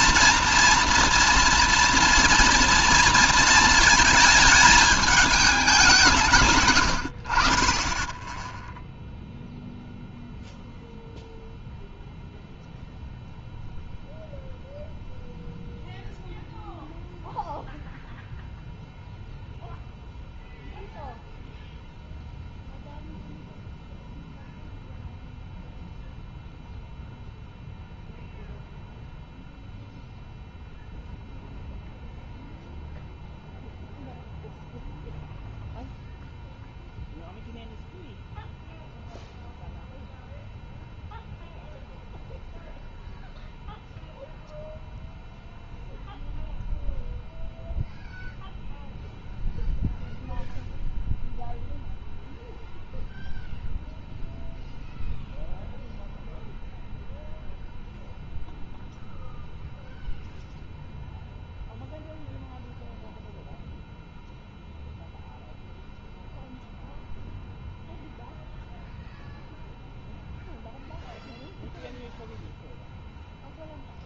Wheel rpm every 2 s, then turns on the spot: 240, 230, 220, 100, 0, 0, 0, 0, 0, 0, 0, 0, 0, 0, 0, 0, 0, 0, 0, 0, 0, 0, 0, 0, 0, 0, 0, 0, 0, 0, 0, 0, 0, 0, 0, 0, 0.
none